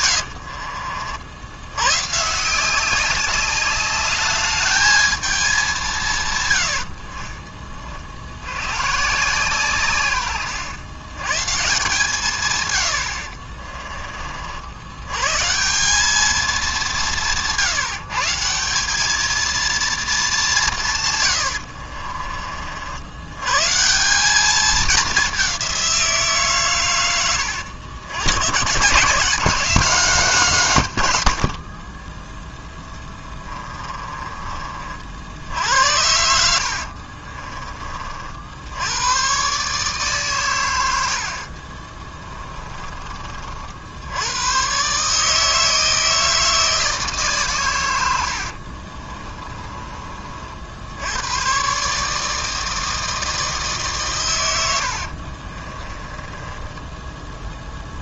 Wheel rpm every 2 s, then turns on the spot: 50, 190, 220, 60, 130, 120, 90, 100, 180, 200, 140, 70, 210, 110, 140, 130, 10, 50, 50, 100, 90, 30, 130, 160, 40, 80, 160, 70, 10.
36-38 48-50 54-58